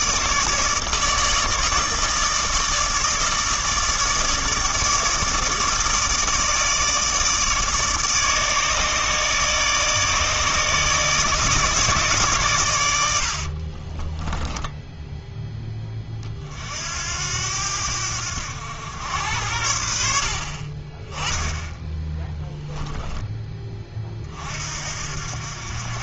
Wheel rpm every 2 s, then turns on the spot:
160, 160, 150, 160, 150, 150, 100, 10, 60, 90, 20, 10, 50.
none